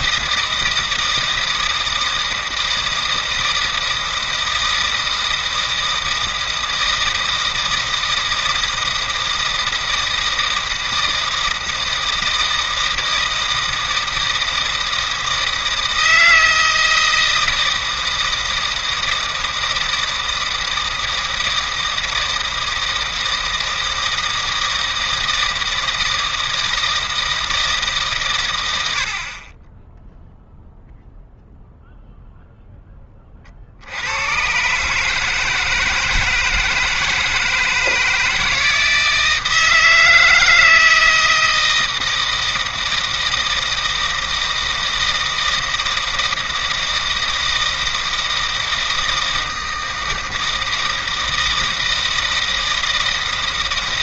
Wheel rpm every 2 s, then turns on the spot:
160, 160, 160, 160, 160, 160, 160, 160, 160, 160, 160, 160, 160, 160, 100, 0, 0, 120, 160, 160, 160, 160, 160, 160, 160, 160, 160.
none